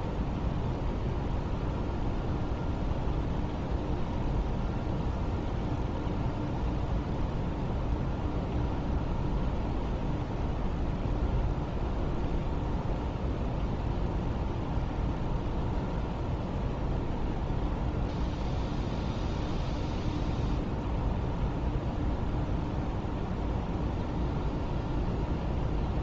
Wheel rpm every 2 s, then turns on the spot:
0, 0, 0, 0, 0, 0, 0, 0, 0, 0, 0, 0, 0.
none